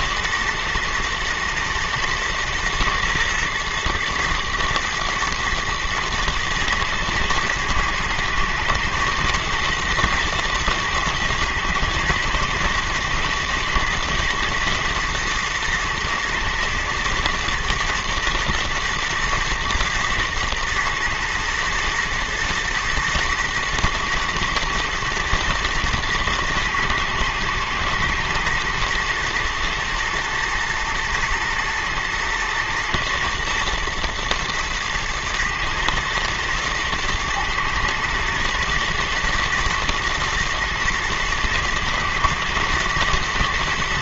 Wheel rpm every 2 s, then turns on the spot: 120, 120, 120, 110, 110, 120, 120, 120, 120, 120, 120, 110, 120, 110, 120, 120, 120, 110, 120, 120, 120, 110.
none